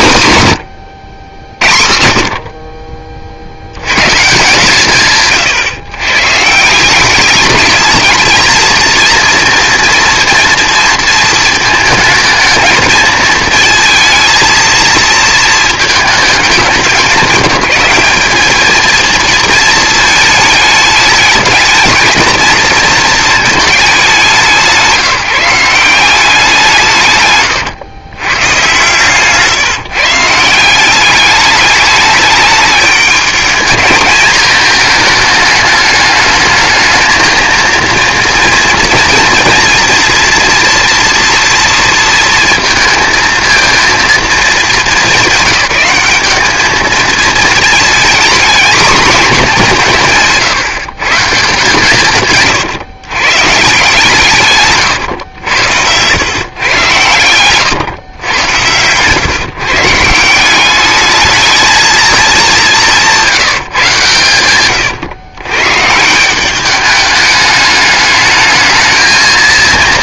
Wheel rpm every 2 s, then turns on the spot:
140, 50, 150, 170, 230, 230, 220, 230, 190, 220, 210, 230, 180, 170, 130, 180, 220, 220, 220, 230, 230, 230, 220, 210, 230, 150, 130, 140, 130, 100, 200, 190, 120, 200, 220.
64-66